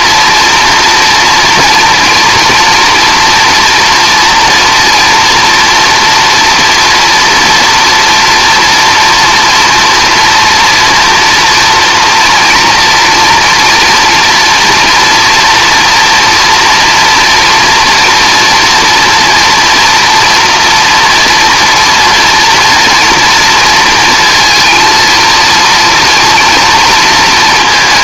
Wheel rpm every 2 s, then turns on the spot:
230, 230, 240, 240, 230, 230, 240, 240, 230, 230, 240, 230, 230, 230.
none